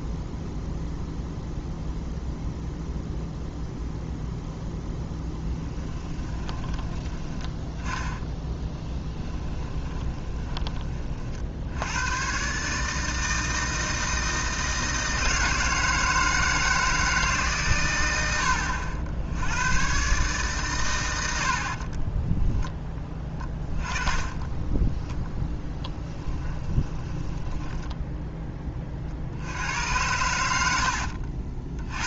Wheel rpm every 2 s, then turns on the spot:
0, 0, 0, 10, 10, 30, 150, 160, 160, 80, 110, 10, 20, 20, 40, 80.
6-10 26-28 30-32